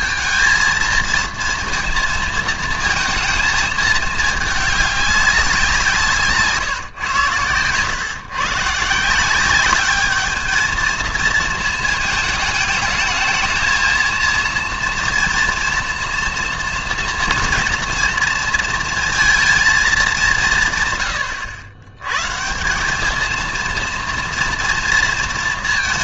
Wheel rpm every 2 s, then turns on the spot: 230, 230, 210, 140, 130, 220, 220, 230, 230, 230, 150, 160, 240.
none